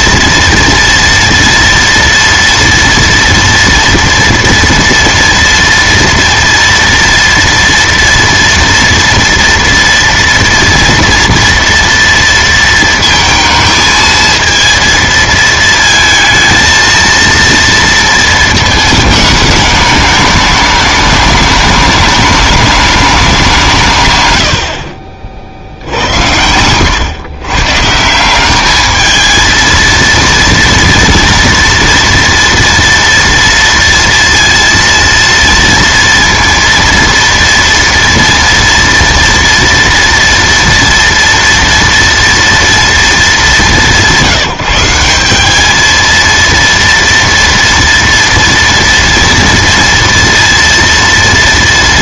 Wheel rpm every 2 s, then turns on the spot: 230, 230, 230, 230, 230, 230, 230, 230, 220, 220, 210, 210, 80, 90, 200, 230, 230, 230, 230, 230, 230, 230, 180, 230, 230, 230.
none